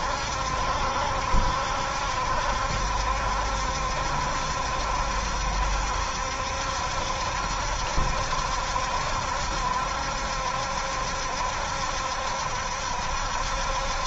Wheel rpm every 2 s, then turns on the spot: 70, 70, 70, 70, 70, 70, 70.
none